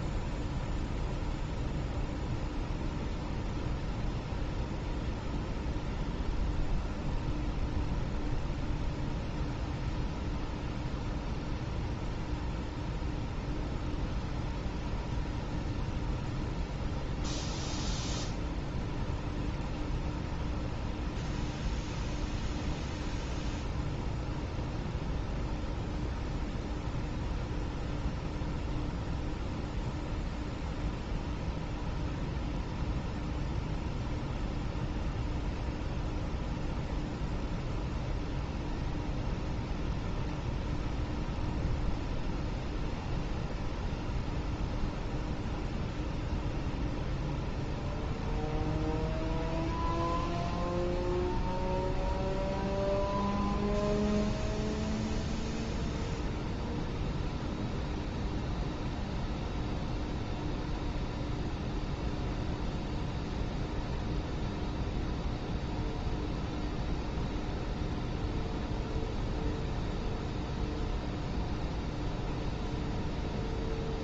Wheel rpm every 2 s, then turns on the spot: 0, 0, 0, 0, 0, 0, 0, 0, 0, 0, 0, 0, 0, 0, 0, 0, 0, 0, 0, 0, 0, 0, 0, 0, 0, 0, 0, 0, 0, 0, 0, 0, 0, 0, 0, 0, 0.
none